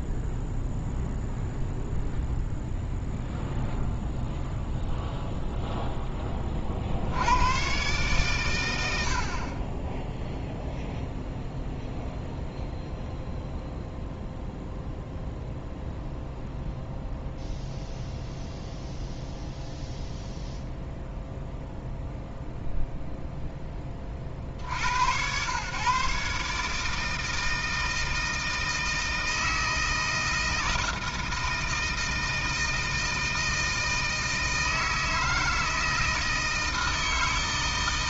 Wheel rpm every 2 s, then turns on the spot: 0, 0, 0, 50, 80, 0, 0, 0, 0, 0, 0, 0, 70, 150, 160, 160, 160, 160, 160.
none